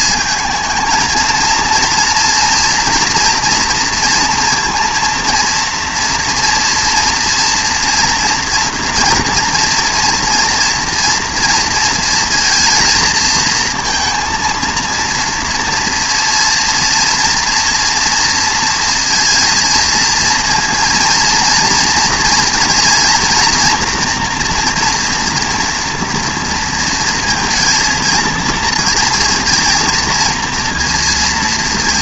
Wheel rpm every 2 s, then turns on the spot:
220, 230, 230, 230, 230, 230, 230, 230, 230, 230, 230, 230, 230, 230, 230, 230.
none